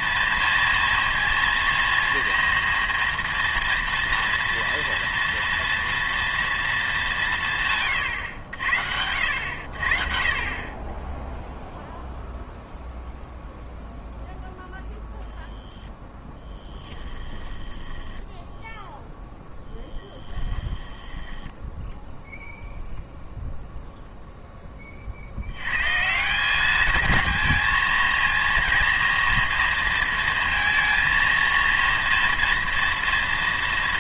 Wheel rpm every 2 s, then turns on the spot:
230, 230, 230, 220, 80, 30, 0, 0, 10, 0, 10, 0, 20, 210, 230, 230, 230.
16-18 20-22